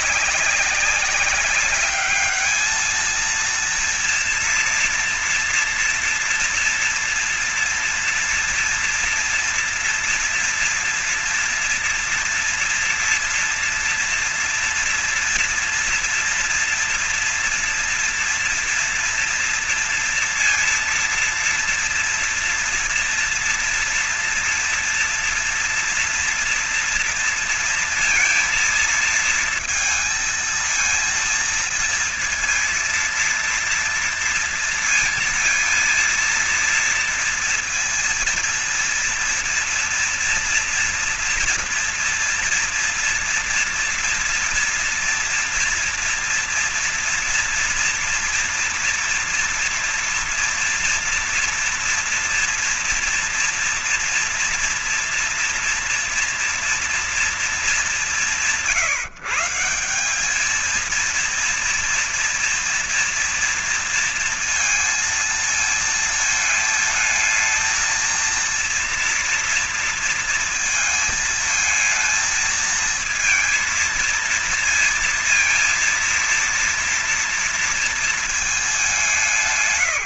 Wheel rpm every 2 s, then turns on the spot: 190, 220, 230, 240, 230, 230, 230, 230, 240, 230, 230, 230, 230, 230, 230, 230, 230, 230, 230, 230, 230, 230, 230, 230, 230, 230, 230, 230, 230, 170, 220, 230, 230, 220, 230, 230, 230, 230, 230, 210.
none